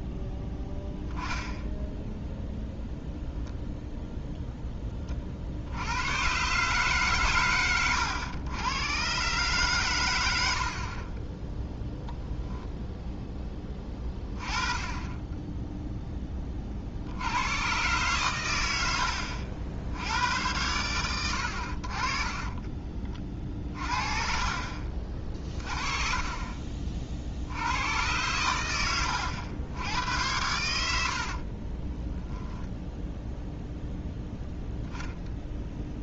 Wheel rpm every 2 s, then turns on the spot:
0, 0, 10, 140, 110, 50, 0, 20, 50, 80, 100, 30, 50, 40, 100, 90, 0, 0.
22-24